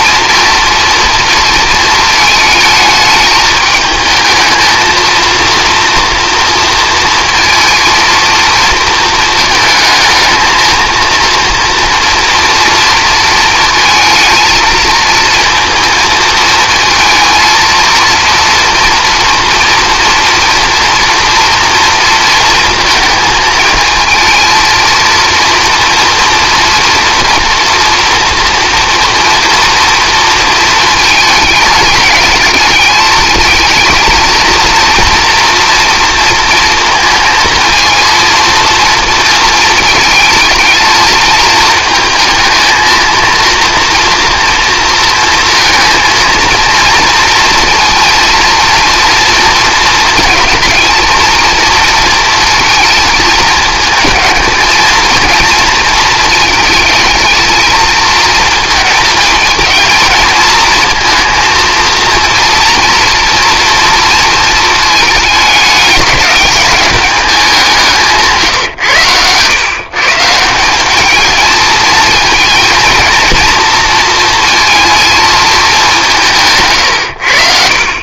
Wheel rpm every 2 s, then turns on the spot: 230, 220, 220, 230, 230, 220, 230, 230, 220, 230, 230, 230, 230, 230, 230, 220, 210, 230, 230, 230, 220, 220, 230, 230, 230, 230, 220, 220, 220, 220, 230, 230, 220, 210, 140, 180, 230, 230, 140.
68-70